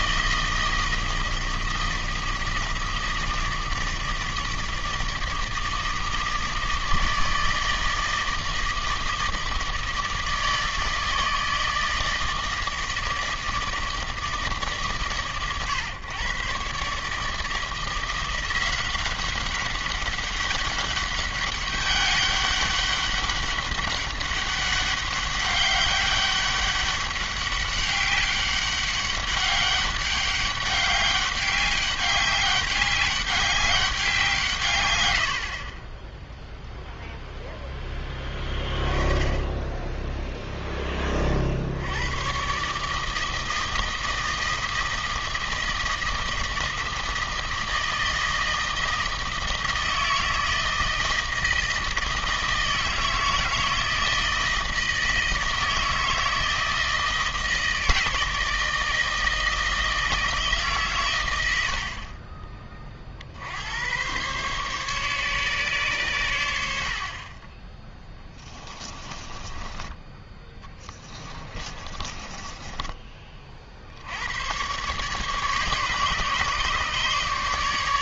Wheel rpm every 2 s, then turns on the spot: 160, 160, 160, 160, 160, 160, 160, 130, 150, 190, 200, 200, 200, 200, 200, 200, 200, 110, 0, 20, 20, 150, 160, 160, 160, 160, 160, 160, 160, 160, 130, 40, 140, 60, 20, 30, 20, 130, 150.
68-74